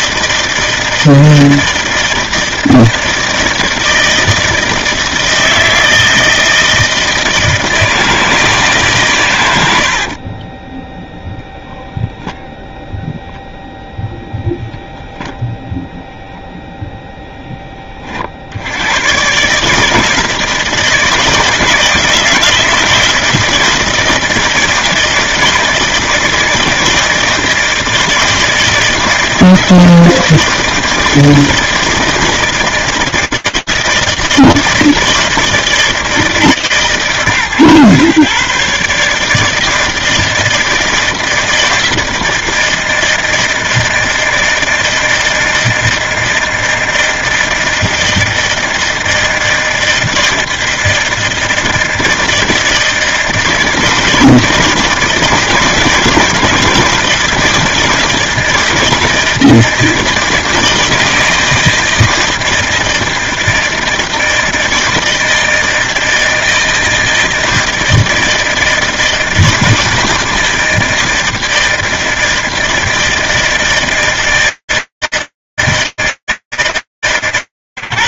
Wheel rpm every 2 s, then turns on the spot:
160, 160, 160, 160, 150, 10, 0, 0, 0, 70, 160, 160, 160, 160, 160, 160, 160, 160, 150, 130, 160, 160, 160, 160, 160, 160, 160, 160, 160, 160, 160, 160, 160, 160, 160, 160, 160, 160, 140.
10-12